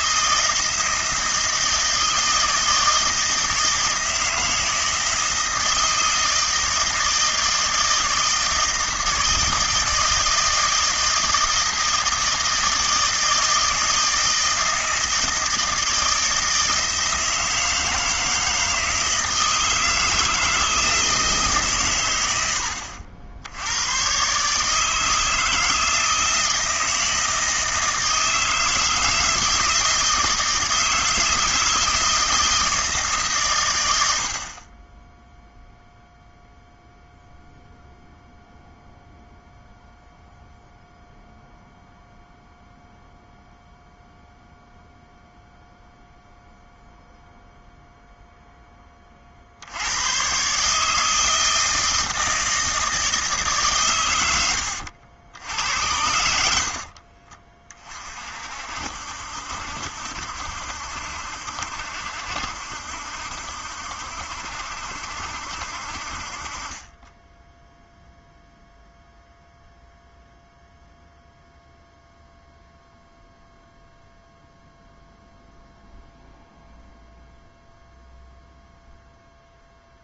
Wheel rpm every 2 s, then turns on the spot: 160, 160, 160, 160, 160, 160, 160, 160, 160, 160, 160, 80, 150, 160, 160, 160, 160, 30, 0, 0, 0, 0, 0, 0, 10, 140, 160, 80, 50, 60, 70, 70, 70, 30, 0, 0, 0, 0, 0, 0.
none